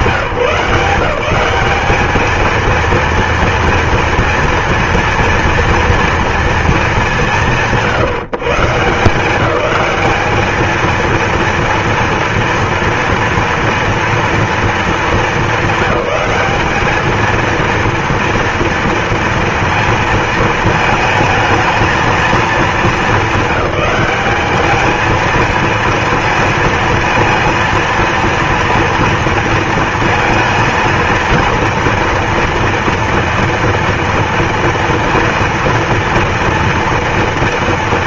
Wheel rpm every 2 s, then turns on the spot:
180, 230, 230, 190, 160, 230, 230, 220, 210, 230, 220, 220, 210, 220, 230, 230, 230, 230, 230.
none